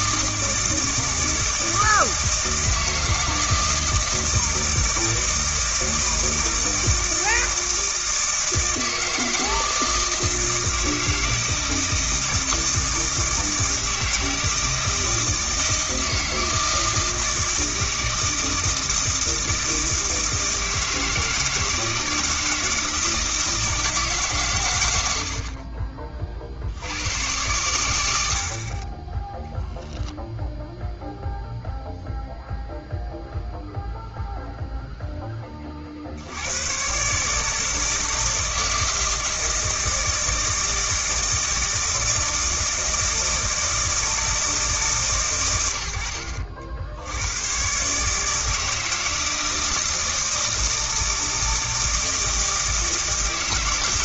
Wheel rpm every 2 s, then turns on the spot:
160, 160, 160, 160, 160, 160, 160, 160, 160, 160, 160, 160, 110, 70, 50, 0, 0, 0, 100, 160, 160, 160, 160, 70, 160, 160, 160.
none